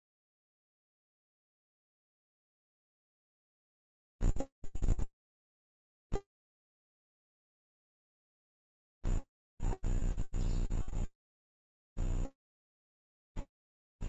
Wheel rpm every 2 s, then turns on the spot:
0, 0, 0, 0, 0, 0, 0.
none